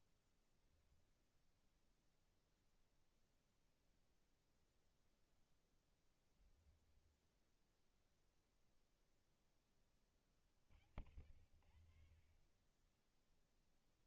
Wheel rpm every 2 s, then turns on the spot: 0, 0, 0, 10, 0, 50, 20.
6-8